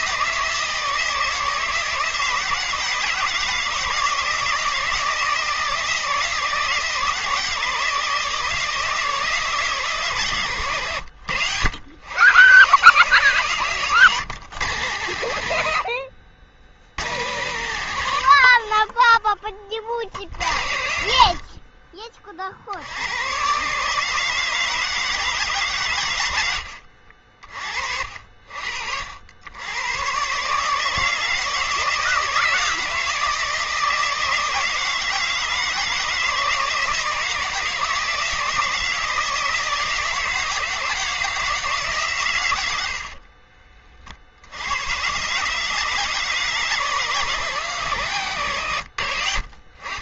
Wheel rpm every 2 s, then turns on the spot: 160, 160, 160, 160, 160, 120, 130, 130, 90, 30, 70, 60, 160, 70, 60, 150, 160, 160, 160, 160, 160, 90, 90, 150, 110.
48-50